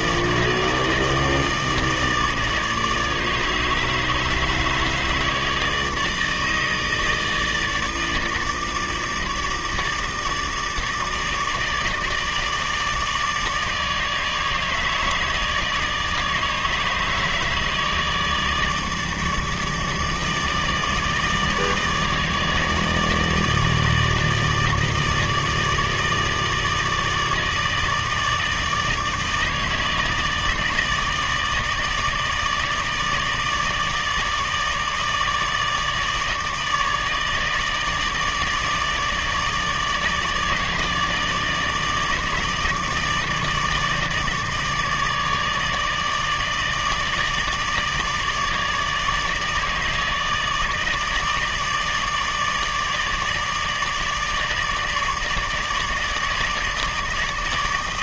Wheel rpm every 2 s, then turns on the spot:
160, 150, 150, 160, 150, 150, 150, 150, 150, 160, 160, 160, 160, 160, 150, 150, 160, 150, 150, 150, 160, 150, 150, 150, 150, 150, 150, 160, 150.
none